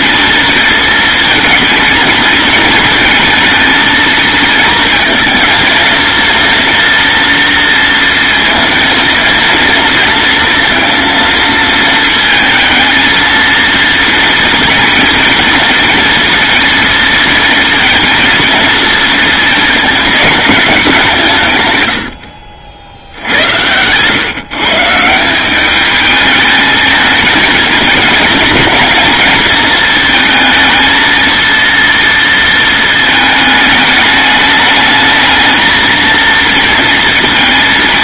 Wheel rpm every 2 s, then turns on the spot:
230, 220, 220, 240, 230, 230, 230, 230, 230, 230, 190, 70, 150, 220, 230, 230, 220, 220, 230.
none